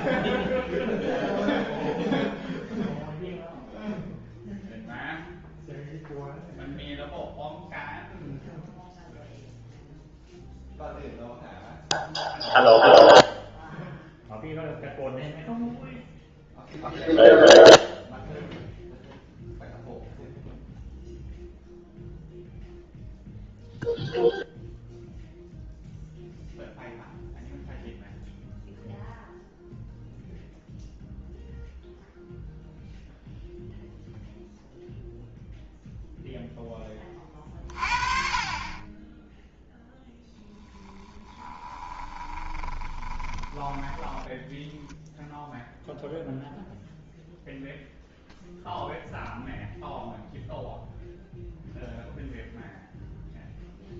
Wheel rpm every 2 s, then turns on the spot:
0, 0, 0, 0, 0, 0, 0, 0, 0, 0, 0, 0, 0, 0, 0, 0, 0, 0, 20, 20, 10, 20, 0, 0, 0, 0, 0.
42-44